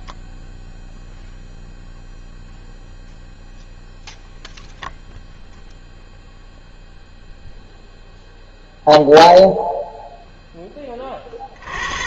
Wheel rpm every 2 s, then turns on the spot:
0, 0, 0, 0, 0, 50.
none